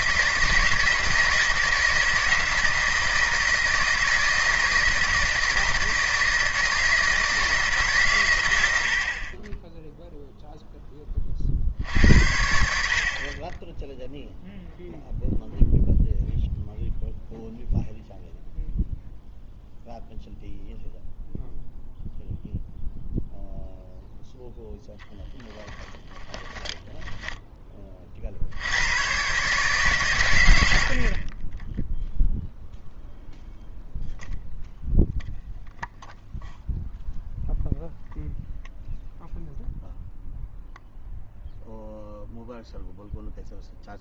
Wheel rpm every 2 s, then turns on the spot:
160, 170, 160, 160, 60, 10, 60, 0, 0, 0, 0, 0, 10, 0, 90, 70, 0, 0, 0, 0, 0, 0.
24-26